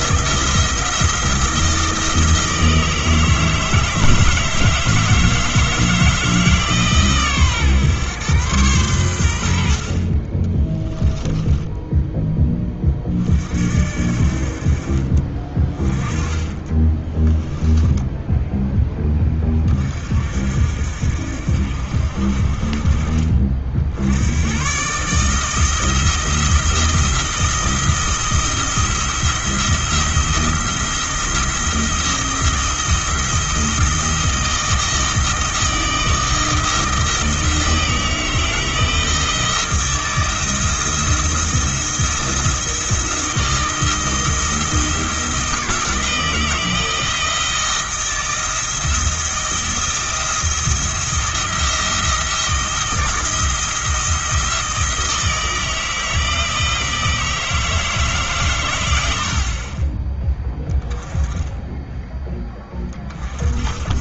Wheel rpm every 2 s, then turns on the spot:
170, 160, 160, 150, 110, 10, 20, 40, 20, 10, 60, 40, 120, 170, 170, 170, 160, 160, 160, 160, 170, 170, 170, 170, 170, 170, 170, 160, 160, 110, 10, 20.
10-12